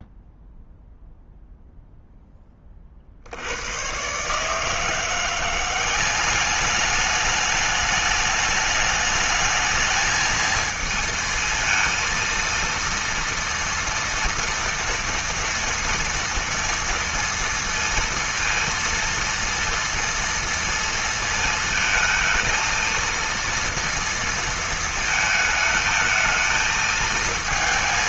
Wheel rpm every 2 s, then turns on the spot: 0, 30, 150, 200, 210, 220, 230, 230, 230, 230, 230, 230, 230, 220.
none